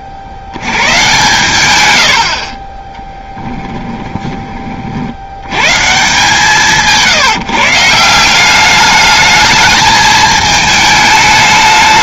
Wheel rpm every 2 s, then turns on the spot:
70, 30, 40, 170, 200, 220.
2-4